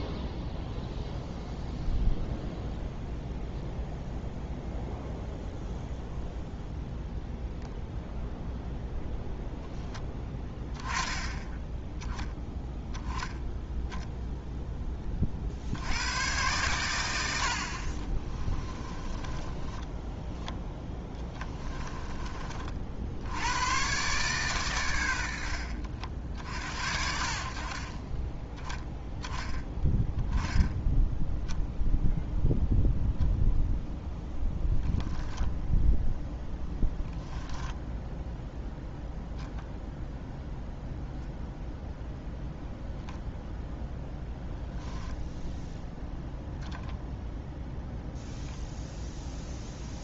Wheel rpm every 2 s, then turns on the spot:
0, 0, 0, 0, 0, 10, 10, 10, 110, 20, 10, 60, 110, 60, 10, 10, 0, 20, 10, 0, 0, 0, 0, 0, 0.
18-22 34-38